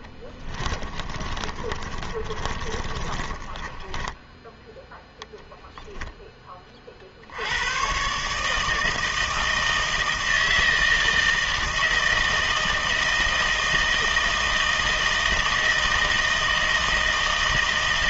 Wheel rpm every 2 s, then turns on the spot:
30, 30, 10, 30, 160, 160, 160, 160, 160.
0-4